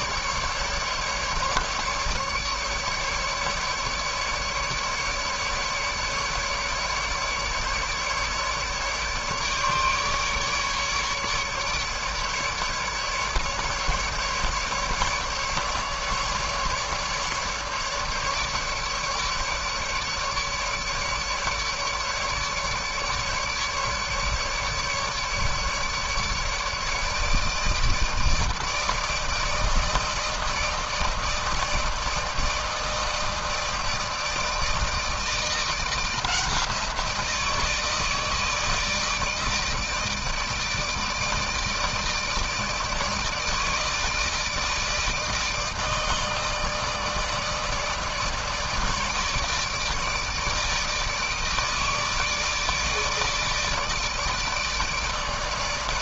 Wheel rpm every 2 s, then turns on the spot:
150, 150, 150, 150, 150, 150, 150, 150, 150, 150, 150, 150, 150, 150, 160, 160, 160, 160, 170, 160, 160, 160, 150, 160, 150, 160, 150, 160.
none